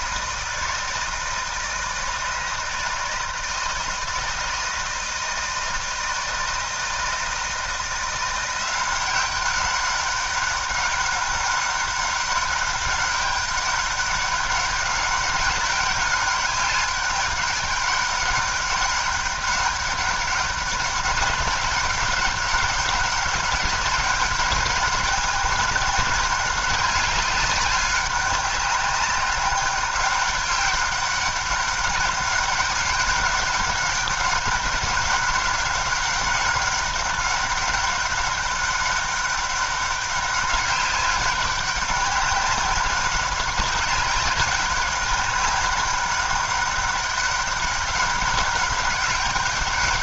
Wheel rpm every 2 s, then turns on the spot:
160, 160, 160, 160, 180, 200, 200, 200, 200, 200, 200, 190, 200, 200, 200, 200, 200, 200, 200, 200, 200, 200, 200, 200, 200.
none